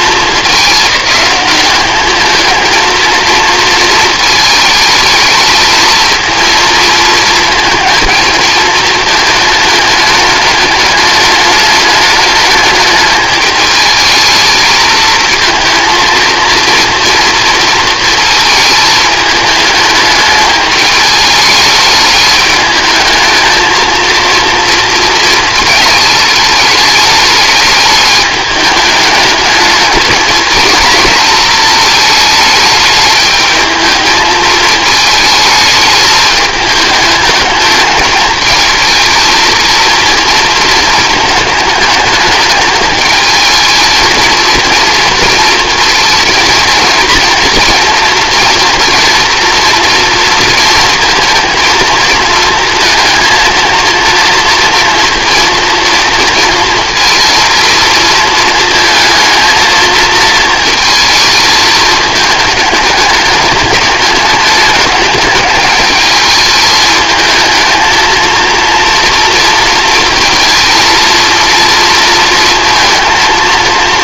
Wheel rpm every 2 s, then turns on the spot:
210, 230, 220, 220, 220, 210, 210, 220, 230, 220, 210, 210, 230, 210, 210, 220, 210, 220, 210, 220, 220, 220, 230, 230, 240, 230, 230, 230, 230, 220, 230, 210, 210, 220, 230, 230, 230.
none